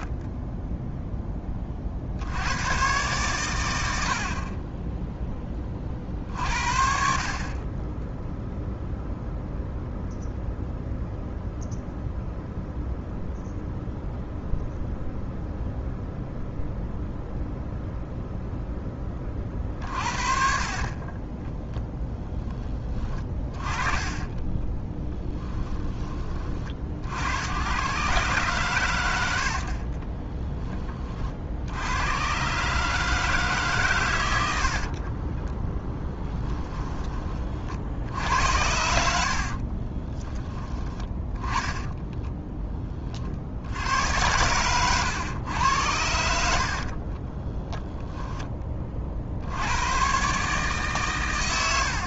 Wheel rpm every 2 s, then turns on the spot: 10, 120, 10, 50, 0, 0, 0, 0, 0, 10, 30, 20, 10, 70, 90, 30, 150, 30, 20, 70, 10, 40, 110, 50, 40, 130.
24-26 34-36 38-40 46-48